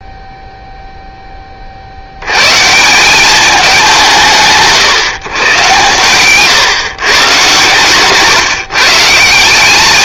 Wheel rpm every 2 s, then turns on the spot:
10, 180, 140, 140, 160.
none